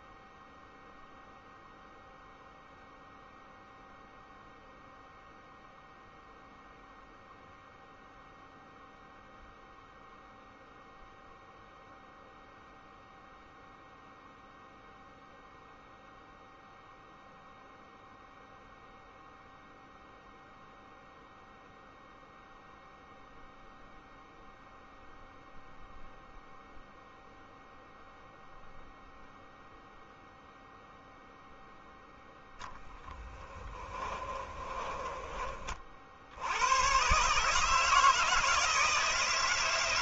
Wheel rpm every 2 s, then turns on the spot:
0, 0, 0, 0, 0, 0, 0, 0, 0, 0, 0, 0, 0, 0, 0, 0, 20, 30, 110, 160.
32-36